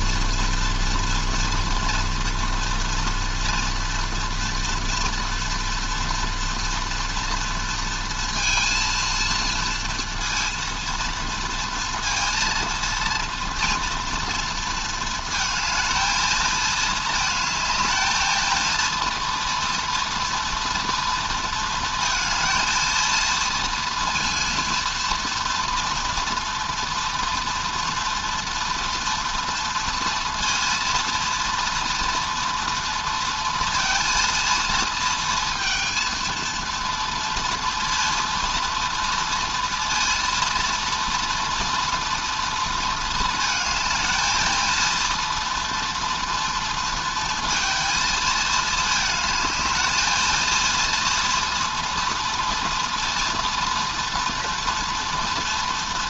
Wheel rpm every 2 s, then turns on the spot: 230, 230, 230, 230, 230, 230, 230, 230, 220, 230, 230, 230, 230, 240, 240, 230, 230, 230, 230, 230, 240, 230, 230, 230, 220, 230, 230, 230.
none